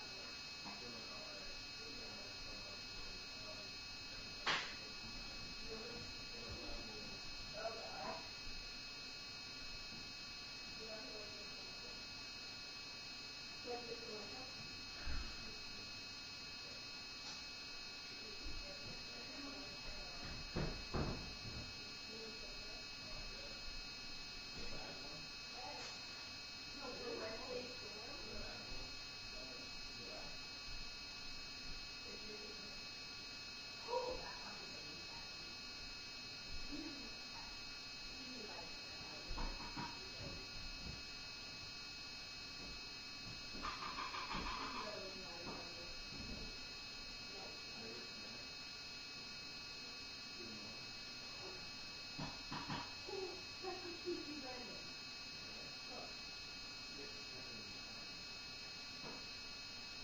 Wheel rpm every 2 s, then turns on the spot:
0, 0, 0, 0, 0, 0, 0, 0, 0, 0, 0, 0, 0, 0, 0, 0, 0, 0, 0, 0, 0, 0, 0, 0, 0, 0, 0, 0, 0, 0.
none